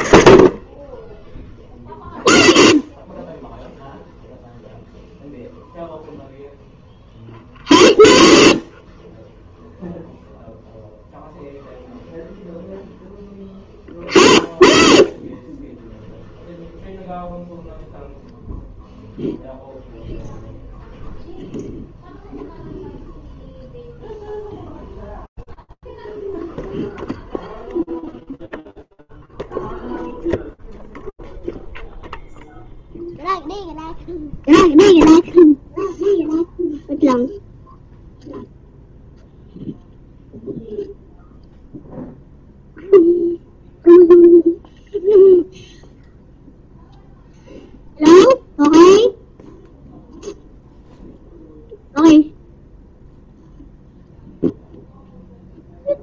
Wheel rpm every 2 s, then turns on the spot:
40, 0, 0, 0, 0, 0, 0, 0, 0, 0, 0, 0, 0, 0, 0, 0, 0, 0, 0, 0, 0, 0, 0, 0, 0, 0, 0, 0.
none